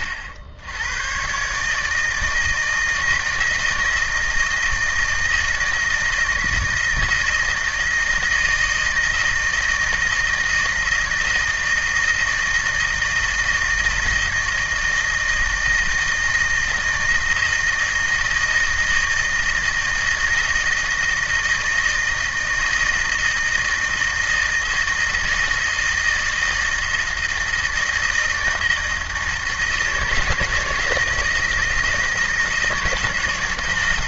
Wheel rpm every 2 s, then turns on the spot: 100, 160, 160, 160, 160, 160, 160, 160, 160, 160, 160, 160, 160, 160, 160, 160, 160.
none